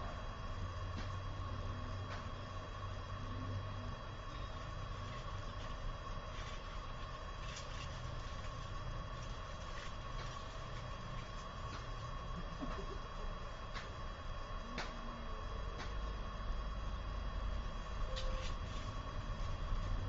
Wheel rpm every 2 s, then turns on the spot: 0, 0, 0, 0, 0, 0, 0, 0, 0, 0.
none